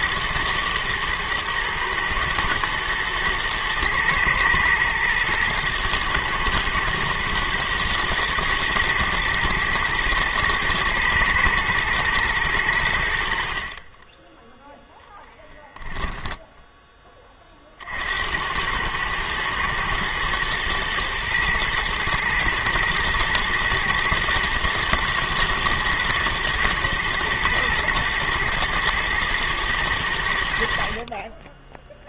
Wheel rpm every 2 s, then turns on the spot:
120, 110, 110, 110, 110, 120, 100, 10, 10, 90, 110, 110, 120, 110, 110, 70.
16-18